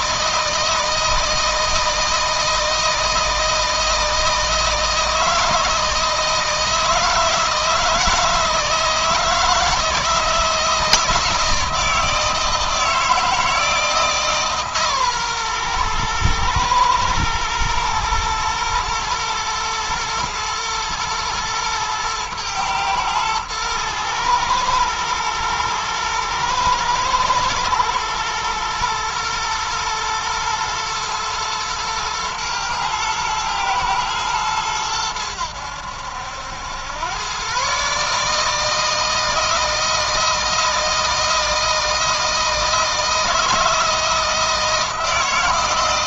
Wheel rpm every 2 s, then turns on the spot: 160, 160, 160, 160, 160, 160, 160, 140, 110, 120, 110, 110, 110, 110, 110, 120, 110, 100, 100, 160, 160, 160, 160.
none